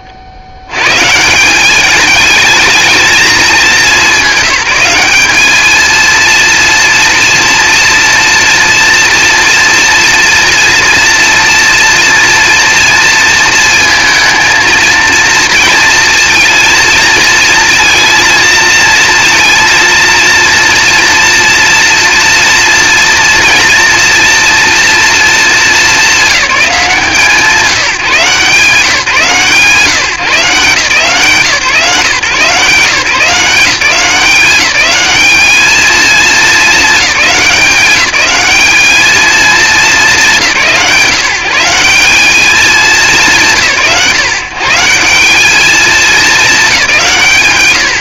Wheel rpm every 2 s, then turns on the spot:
90, 220, 190, 230, 230, 230, 230, 230, 230, 220, 230, 240, 230, 160, 160, 140, 150, 200, 200, 210, 160, 200, 160, 200.
none